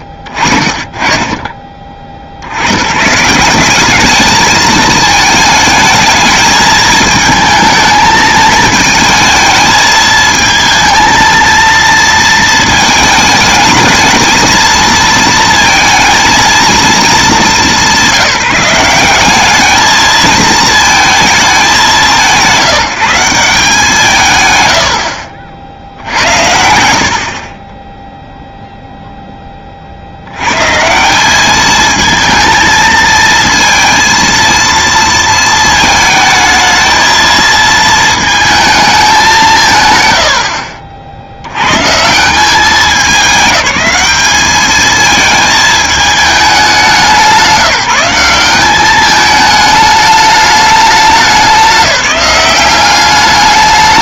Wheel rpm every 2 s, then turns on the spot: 30, 90, 220, 220, 220, 220, 220, 220, 230, 180, 220, 150, 120, 80, 0, 110, 220, 230, 220, 220, 50, 180, 210, 200, 200, 210, 190.
none